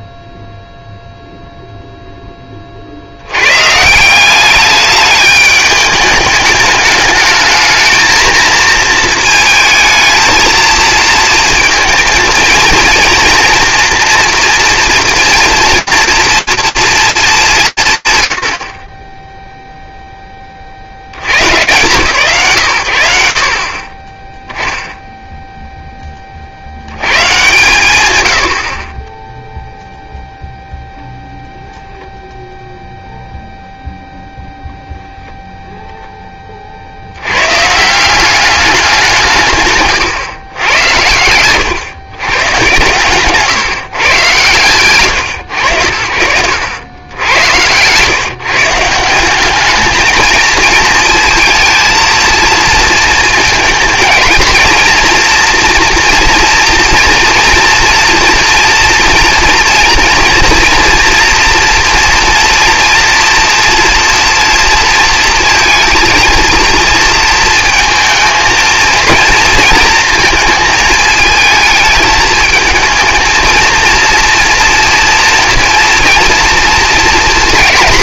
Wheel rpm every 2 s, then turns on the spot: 0, 40, 200, 210, 230, 230, 230, 230, 230, 50, 20, 90, 0, 100, 30, 0, 0, 0, 70, 180, 100, 140, 120, 100, 170, 220, 220, 230, 240, 230, 230, 230, 230, 230, 230, 220, 220, 230, 230.
none